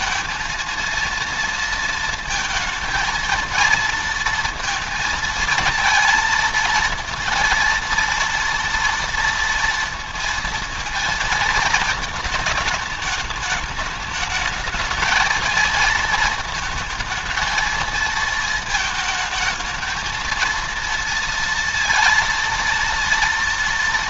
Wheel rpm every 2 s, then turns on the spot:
230, 230, 230, 230, 230, 230, 210, 220, 220, 220, 230, 230.
none